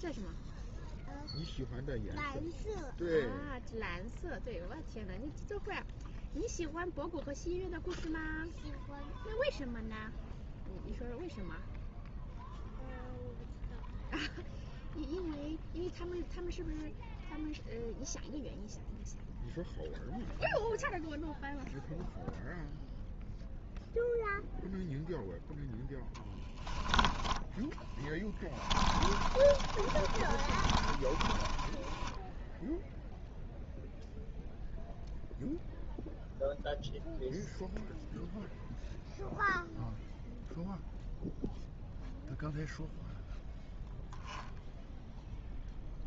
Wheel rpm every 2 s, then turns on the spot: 0, 0, 0, 0, 0, 0, 0, 0, 0, 0, 0, 0, 0, 10, 20, 30, 0, 0, 0, 0, 0, 0, 0.
26-32